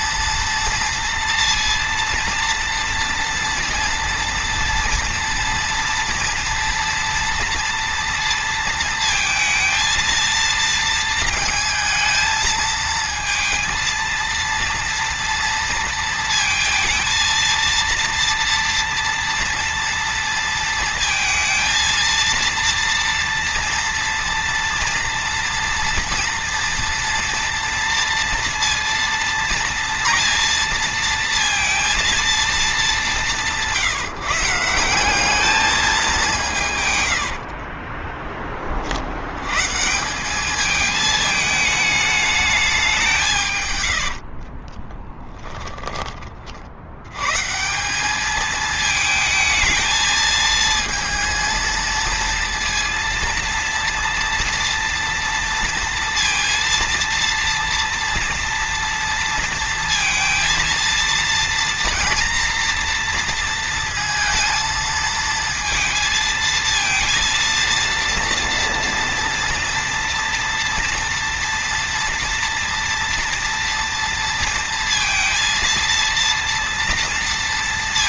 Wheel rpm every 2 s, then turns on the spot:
230, 230, 240, 240, 230, 230, 230, 230, 220, 230, 230, 230, 230, 240, 230, 230, 210, 180, 140, 60, 210, 190, 30, 80, 220, 220, 230, 230, 230, 230, 230, 230, 220, 230, 230, 230, 230, 230, 230.
36-38 44-46